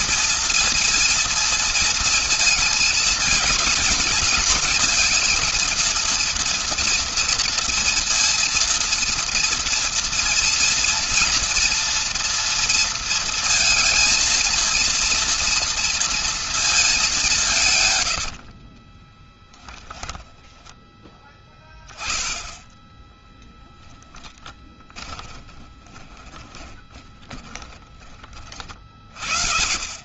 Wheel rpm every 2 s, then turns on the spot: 230, 230, 230, 230, 230, 230, 230, 230, 230, 70, 10, 10, 20, 20, 40.
18-22 24-28